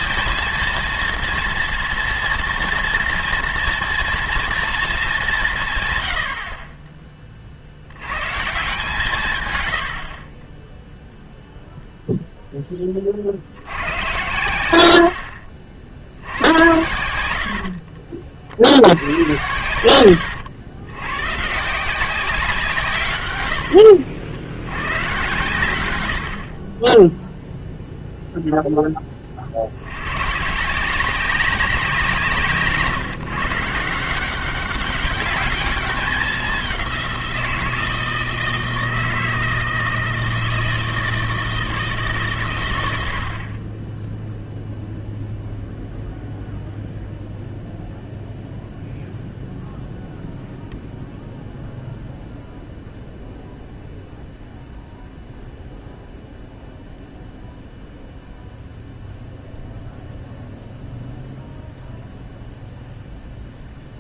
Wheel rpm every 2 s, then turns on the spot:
230, 230, 230, 40, 150, 10, 20, 90, 90, 60, 100, 160, 100, 30, 10, 160, 150, 190, 190, 160, 160, 100, 0, 0, 0, 0, 0, 0, 0, 0, 0, 0.
16-18